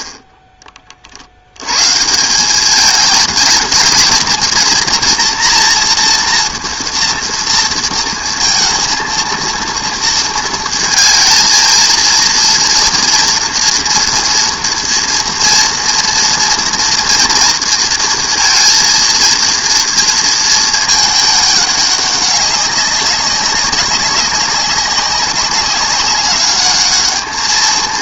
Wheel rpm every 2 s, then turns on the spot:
30, 210, 230, 230, 230, 220, 230, 230, 240, 230, 220, 190, 190, 210.
none